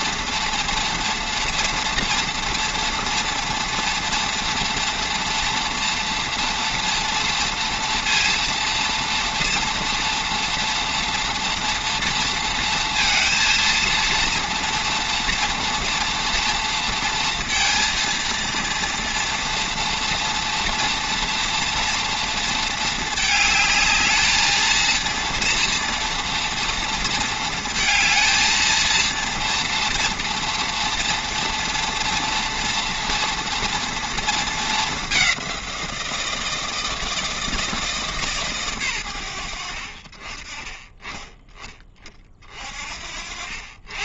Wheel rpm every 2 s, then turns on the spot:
230, 230, 230, 230, 230, 230, 230, 230, 230, 230, 230, 230, 220, 230, 220, 230, 230, 220, 170, 150, 30, 40.
none